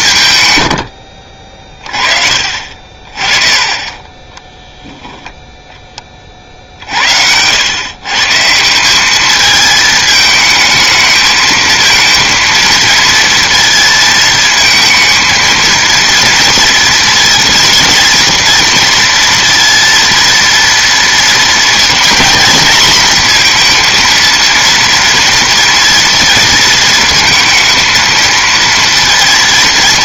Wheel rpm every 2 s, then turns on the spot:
110, 40, 10, 50, 170, 220, 230, 220, 230, 230, 230, 240, 230, 230, 230.
4-6